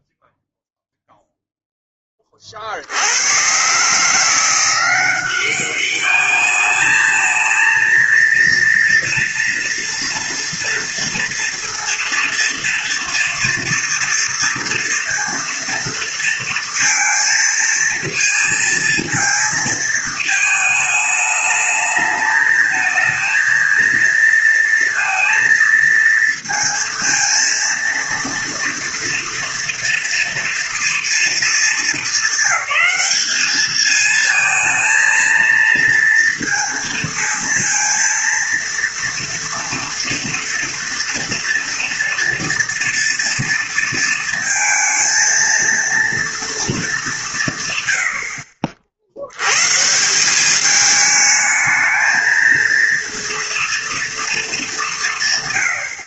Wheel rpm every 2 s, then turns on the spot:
0, 50, 170, 210, 230, 230, 230, 230, 230, 230, 220, 220, 230, 230, 230, 230, 200, 230, 230, 230, 230, 230, 230, 230, 60, 200, 220, 210.
none